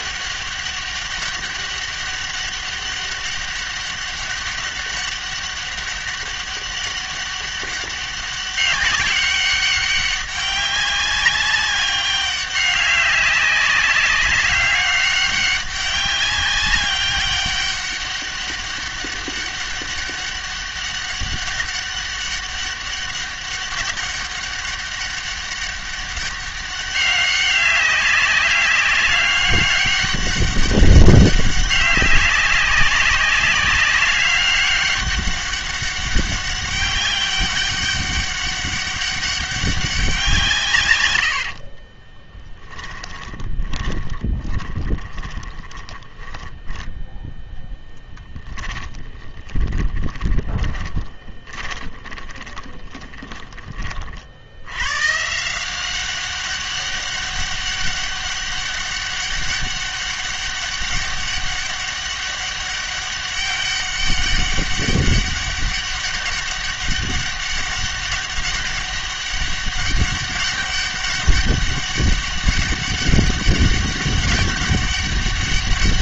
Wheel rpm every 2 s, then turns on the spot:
200, 200, 200, 200, 200, 200, 200, 200, 190, 200, 200, 200, 200, 200, 200, 200, 200, 200, 200, 200, 120, 10, 20, 10, 20, 10, 20, 100, 200, 200, 200, 200, 200, 200, 200, 200, 200, 200.
42-54